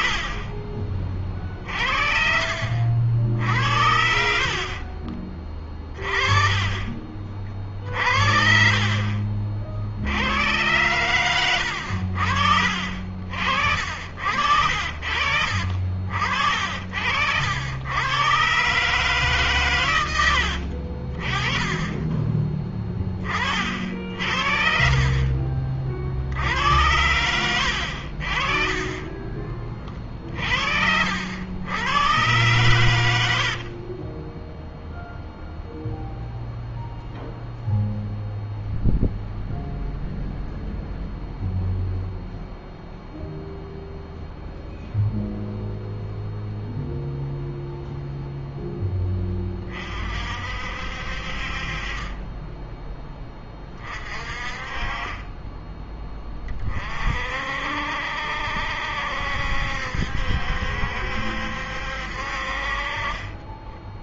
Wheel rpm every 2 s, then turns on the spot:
40, 50, 50, 30, 50, 100, 60, 60, 60, 140, 70, 20, 60, 70, 40, 60, 110, 10, 0, 0, 0, 0, 0, 0, 0, 50, 10, 30, 30, 70, 70, 50.
4-6 26-30 32-36